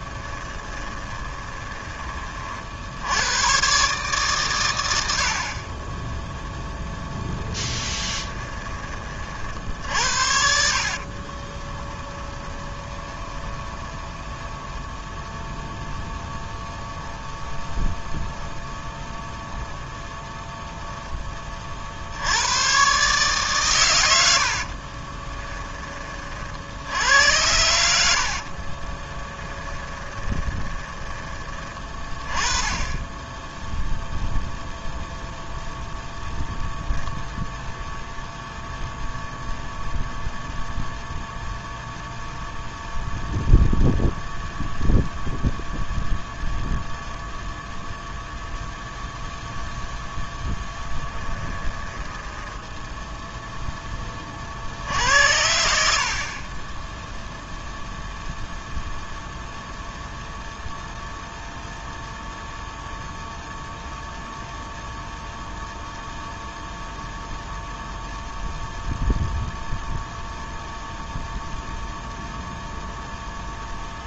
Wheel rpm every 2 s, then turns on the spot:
20, 70, 90, 0, 30, 60, 20, 10, 10, 0, 10, 130, 30, 80, 20, 20, 10, 0, 0, 0, 0, 0, 0, 0, 0, 10, 10, 70, 10, 0, 0, 0, 0, 0, 0, 0, 0.
0-2 10-14 24-26 28-32 50-52 56-58